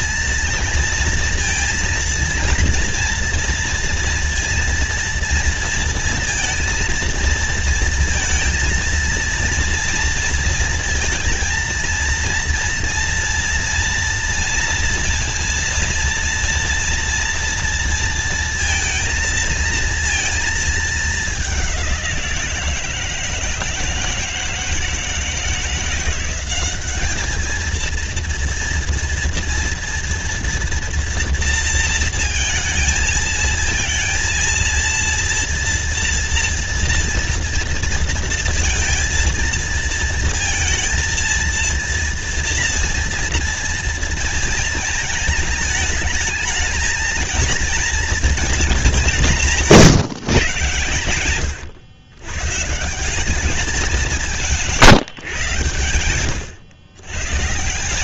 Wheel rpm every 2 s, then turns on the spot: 230, 230, 230, 230, 230, 230, 230, 230, 230, 230, 220, 170, 160, 200, 230, 230, 230, 230, 230, 230, 230, 230, 230, 220, 220, 140, 140, 160, 120.
none